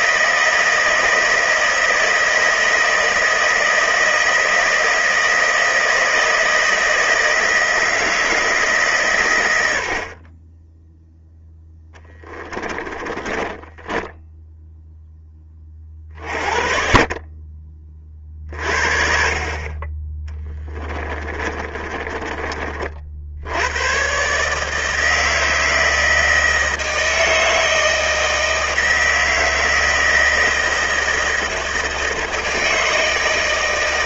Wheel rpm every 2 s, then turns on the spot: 160, 160, 160, 160, 140, 0, 10, 10, 40, 50, 20, 50, 160, 160, 160, 160, 160.
12-14 20-22